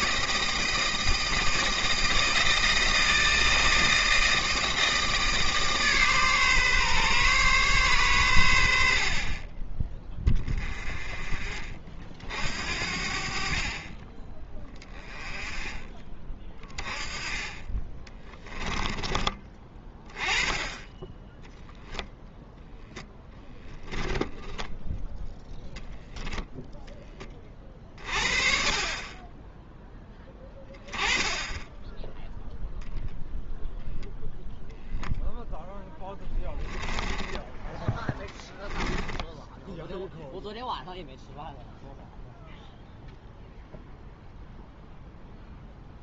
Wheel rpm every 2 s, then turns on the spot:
160, 160, 160, 140, 90, 20, 60, 20, 30, 10, 20, 0, 10, 0, 30, 30, 20, 0, 10, 10, 0, 0, 0.
18-20 24-26 36-40